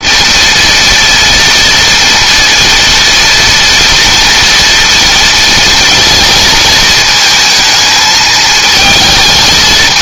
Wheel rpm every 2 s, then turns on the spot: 230, 230, 230, 220, 220.
none